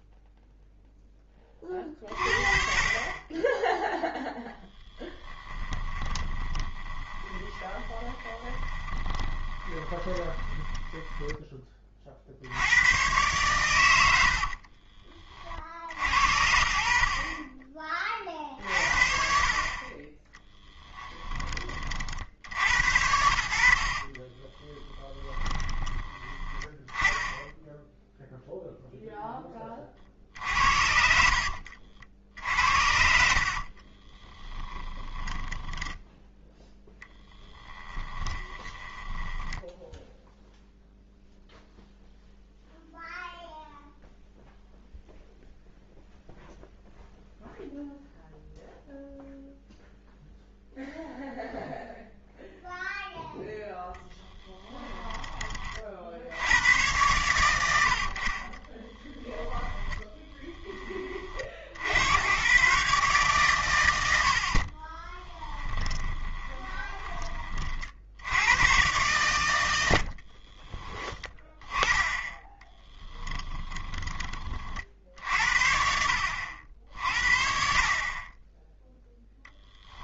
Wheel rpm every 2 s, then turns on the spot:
0, 30, 10, 20, 20, 10, 110, 30, 50, 50, 10, 70, 20, 10, 0, 70, 60, 10, 0, 10, 0, 0, 0, 0, 0, 0, 0, 10, 110, 20, 20, 140, 30, 10, 120, 20, 20, 50, 60, 0.
4-12 14-16 20-22 24-26 32-36 38-40 54-56 58-60 64-68 72-74